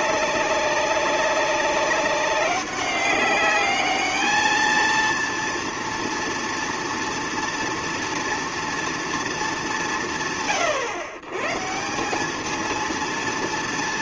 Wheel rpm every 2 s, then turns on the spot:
190, 190, 220, 230, 230, 150, 220.
none